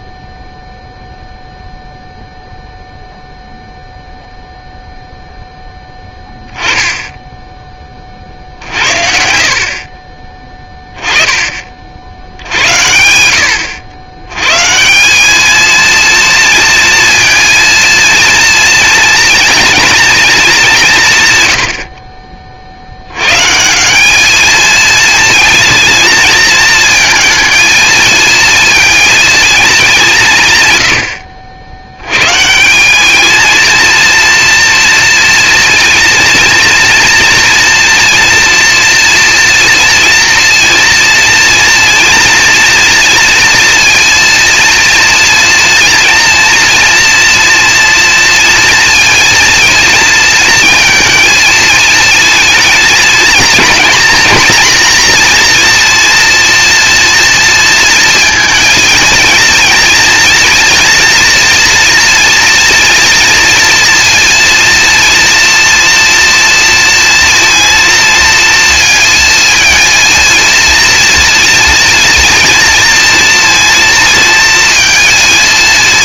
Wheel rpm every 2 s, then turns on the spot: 0, 0, 0, 10, 60, 10, 90, 170, 230, 230, 180, 100, 220, 220, 230, 80, 210, 230, 230, 230, 230, 230, 230, 240, 240, 220, 220, 240, 230, 220, 230, 230, 230, 230, 230, 230, 230, 210.
none